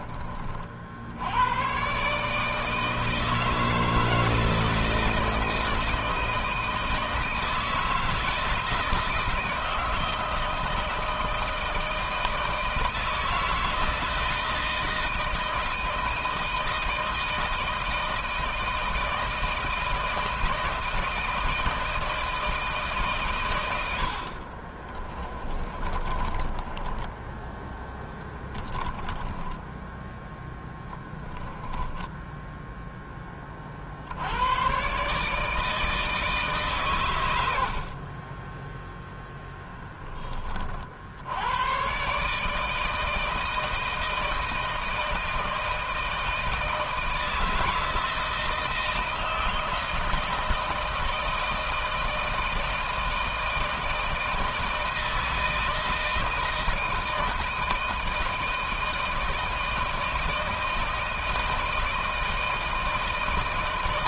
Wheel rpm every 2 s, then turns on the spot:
70, 160, 160, 160, 160, 160, 160, 160, 160, 160, 160, 140, 20, 20, 10, 10, 10, 130, 120, 10, 70, 160, 160, 160, 160, 160, 160, 160, 160, 160, 160, 160.
24-30